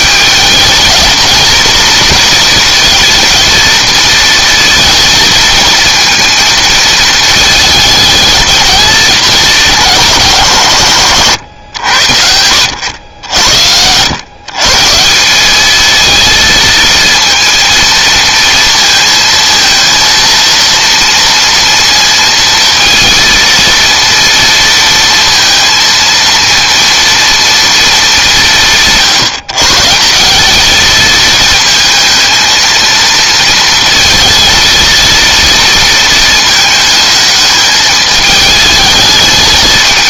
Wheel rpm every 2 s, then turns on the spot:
210, 230, 230, 230, 210, 130, 90, 160, 230, 230, 230, 230, 230, 230, 170, 220, 220, 230, 220, 210.
none